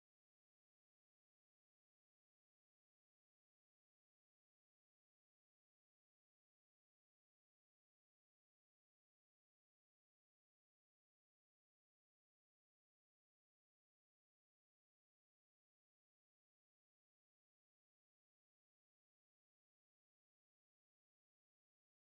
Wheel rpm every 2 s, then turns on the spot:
0, 0, 0, 0, 0, 0, 0, 0, 0, 0, 0.
none